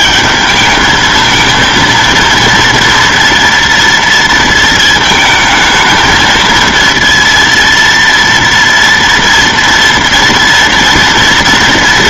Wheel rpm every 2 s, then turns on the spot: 210, 230, 220, 230, 230, 230.
none